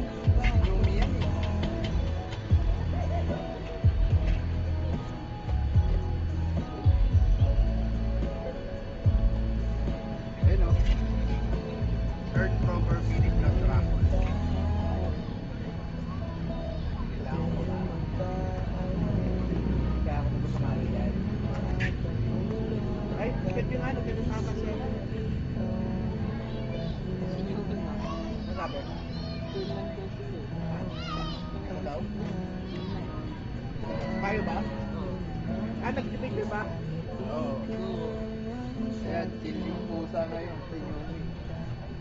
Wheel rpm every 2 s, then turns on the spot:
0, 0, 0, 0, 0, 0, 0, 0, 0, 0, 0, 0, 0, 0, 0, 0, 0, 0, 0, 0, 0.
none